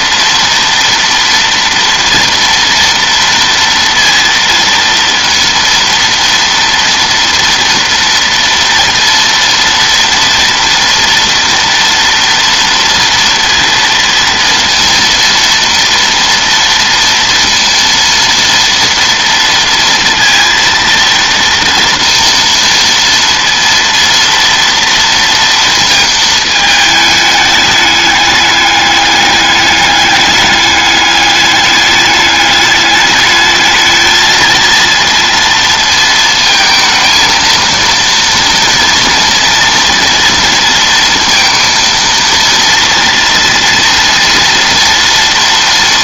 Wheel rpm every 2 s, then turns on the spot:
230, 230, 230, 230, 230, 230, 230, 230, 230, 230, 230, 230, 230, 220, 200, 200, 210, 230, 220, 230, 230, 230, 230.
none